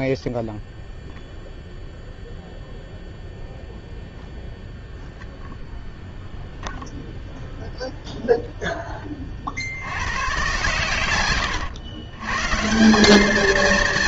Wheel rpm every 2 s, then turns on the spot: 0, 0, 0, 10, 100, 170, 230.
none